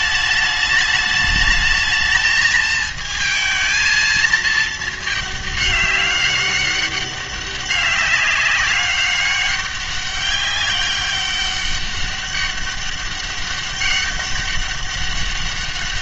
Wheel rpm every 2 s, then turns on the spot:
210, 220, 220, 200, 200, 200, 200, 200.
none